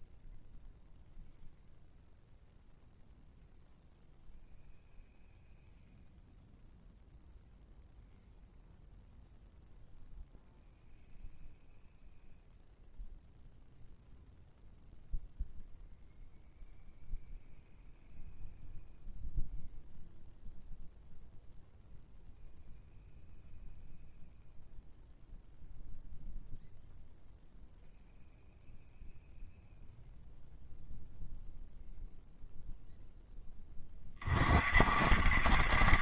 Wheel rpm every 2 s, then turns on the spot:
0, 0, 0, 0, 0, 0, 0, 0, 0, 0, 0, 0, 0, 0, 0, 0, 0, 40.
none